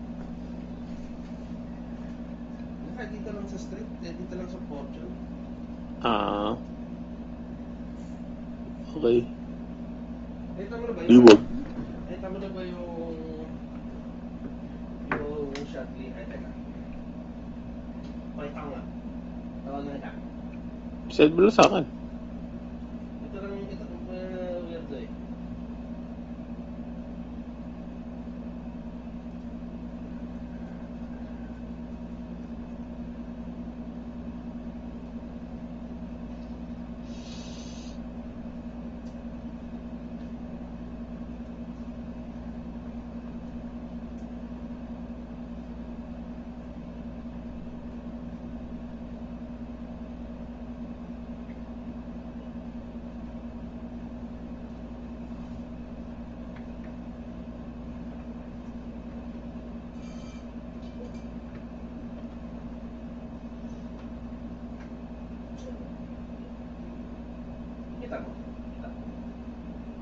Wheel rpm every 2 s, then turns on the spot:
0, 0, 0, 0, 0, 0, 0, 0, 0, 0, 0, 0, 0, 0, 0, 0, 0, 0, 0, 0, 0, 0, 0, 0, 0, 0, 0, 0, 0, 0, 0, 0, 0, 0, 0.
none